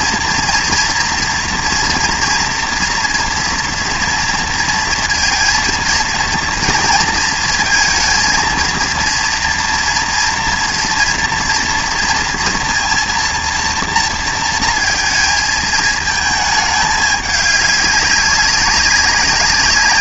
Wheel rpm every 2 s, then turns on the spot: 230, 240, 230, 230, 230, 230, 230, 230, 210, 200.
none